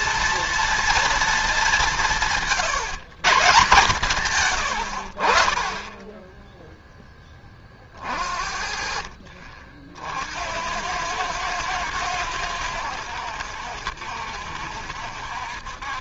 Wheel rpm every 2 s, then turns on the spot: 230, 120, 90, 10, 50, 90, 90, 70.
none